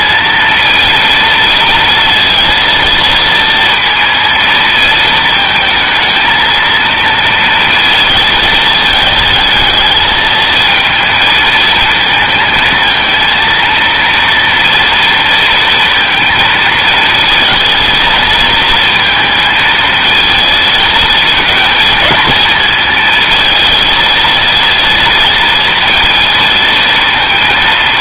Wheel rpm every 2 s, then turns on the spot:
230, 230, 220, 230, 220, 230, 220, 230, 220, 230, 230, 230, 230, 230.
none